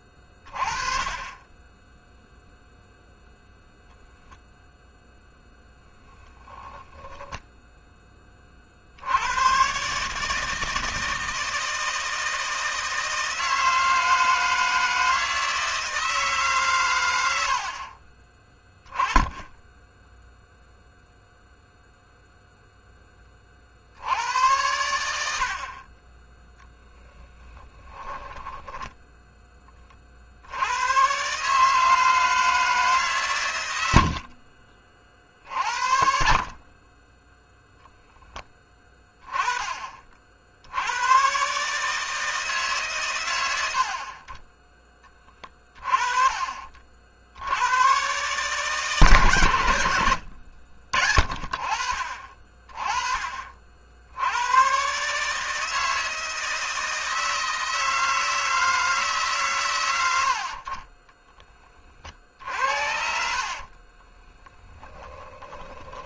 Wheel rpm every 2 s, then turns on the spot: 30, 0, 0, 10, 70, 160, 160, 160, 120, 10, 0, 10, 90, 10, 10, 100, 150, 40, 30, 20, 90, 130, 20, 50, 140, 50, 30, 130, 160, 160, 30, 60, 10.
26-28 62-66